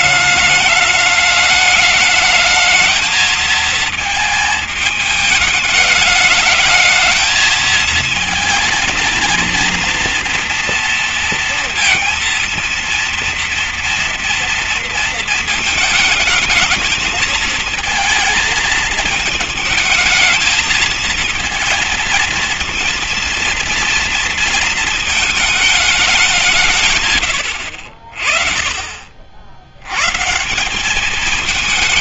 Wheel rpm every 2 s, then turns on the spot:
210, 220, 210, 220, 230, 230, 230, 230, 220, 220, 220, 230, 220, 140, 40, 180.
none